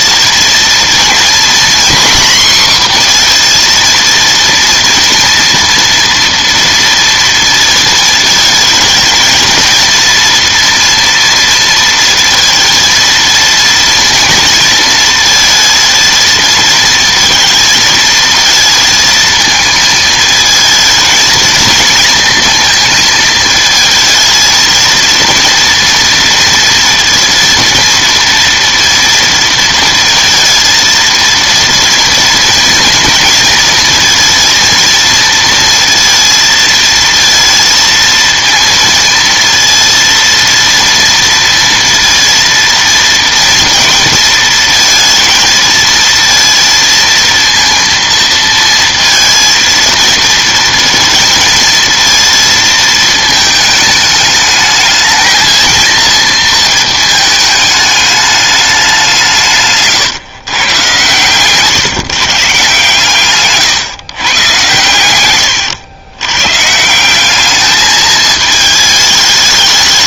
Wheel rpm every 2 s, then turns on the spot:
230, 250, 230, 230, 220, 230, 230, 230, 230, 230, 220, 230, 220, 230, 230, 230, 230, 230, 230, 230, 230, 230, 230, 230, 230, 230, 220, 220, 230, 210, 130, 140, 120, 140, 210.
none